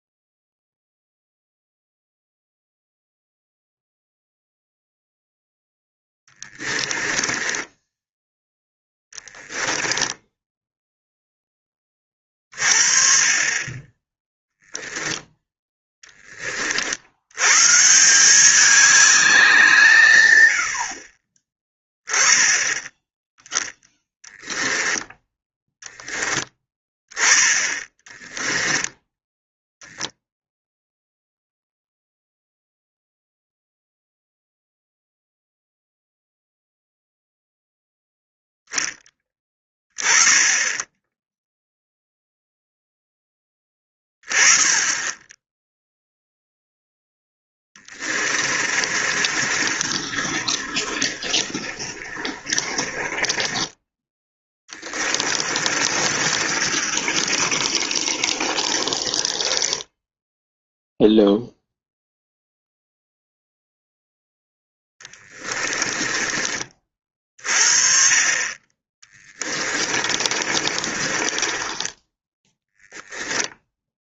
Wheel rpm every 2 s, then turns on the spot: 0, 0, 0, 10, 10, 0, 40, 0, 60, 200, 70, 20, 10, 10, 10, 0, 0, 0, 0, 10, 10, 0, 10, 0, 40, 50, 40, 30, 50, 30, 0, 0, 10, 30, 20, 30, 0.
6-10 28-30 48-60 64-66 68-72